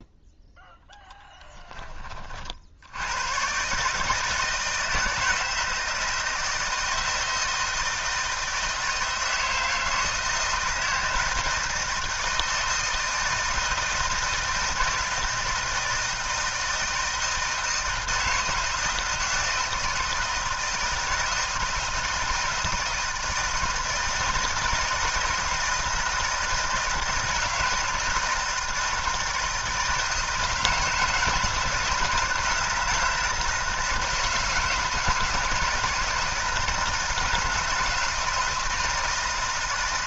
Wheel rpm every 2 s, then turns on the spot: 10, 60, 160, 160, 160, 160, 160, 160, 160, 160, 160, 160, 160, 160, 160, 160, 160, 160, 160, 160.
none